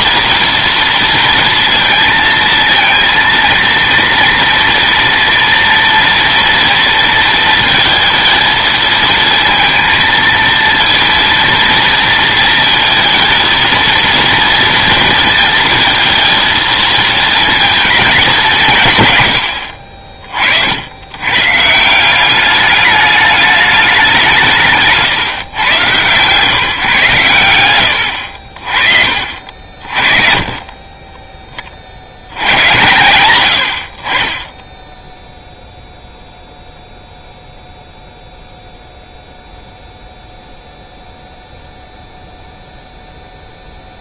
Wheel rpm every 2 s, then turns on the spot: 230, 230, 230, 230, 220, 230, 230, 230, 220, 180, 70, 200, 160, 140, 50, 30, 90, 10, 0, 0, 0, 0.
none